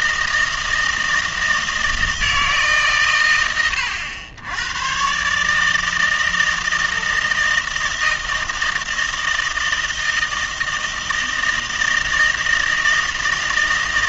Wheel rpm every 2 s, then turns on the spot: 160, 150, 100, 160, 160, 160, 160.
none